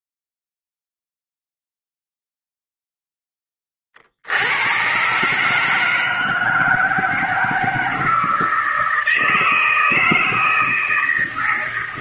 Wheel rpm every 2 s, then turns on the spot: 0, 0, 110, 160, 160, 160.
none